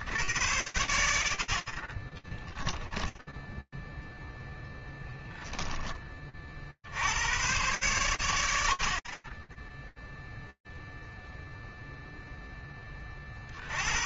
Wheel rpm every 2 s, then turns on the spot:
50, 50, 10, 30, 90, 0, 20.
4-6